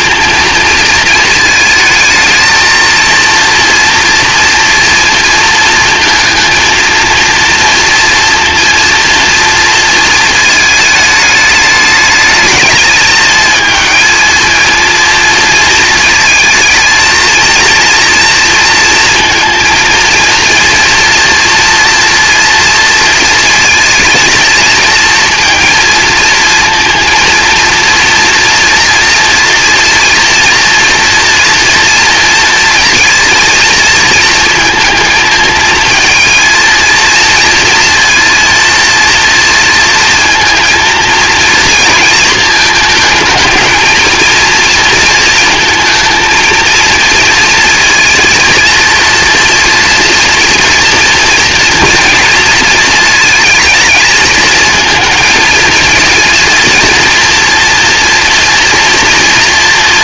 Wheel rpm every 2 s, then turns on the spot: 220, 230, 230, 230, 230, 220, 210, 230, 230, 230, 230, 230, 230, 230, 230, 230, 230, 220, 230, 230, 230, 230, 230, 230, 230, 230, 230, 220, 230, 230.
none